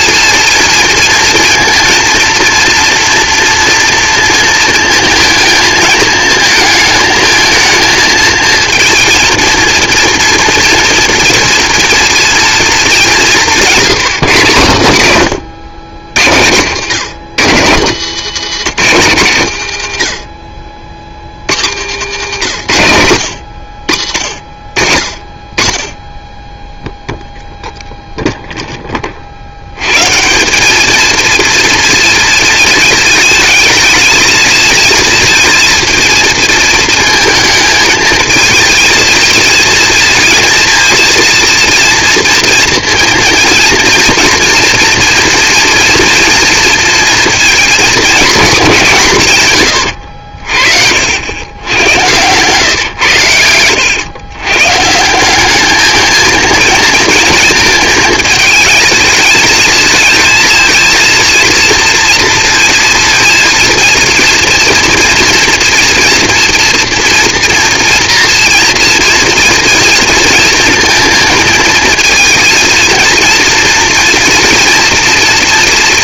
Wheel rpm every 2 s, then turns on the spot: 230, 230, 220, 220, 230, 230, 210, 140, 120, 180, 50, 100, 40, 0, 0, 190, 230, 220, 220, 220, 230, 230, 230, 230, 200, 50, 120, 120, 220, 220, 230, 230, 230, 230, 230, 230, 230, 230.
none